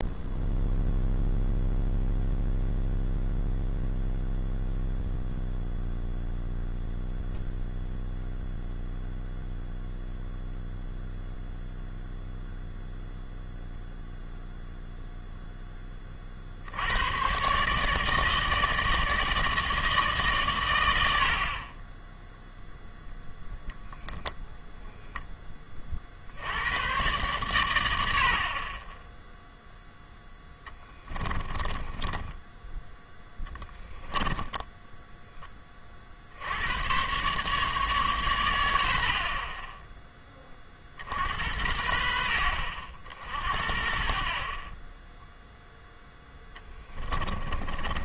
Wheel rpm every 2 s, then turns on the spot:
0, 0, 0, 0, 0, 0, 0, 0, 80, 160, 110, 0, 0, 100, 20, 10, 20, 10, 100, 90, 40, 60, 20, 10.
30-32 34-36 46-48